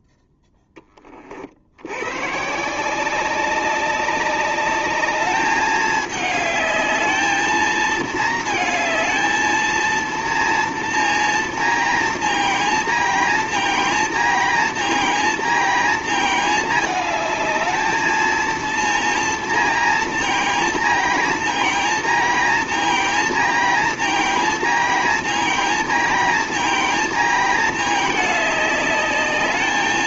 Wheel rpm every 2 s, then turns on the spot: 10, 180, 200, 210, 220, 230, 230, 230, 220, 230, 230, 230, 230, 230, 210.
none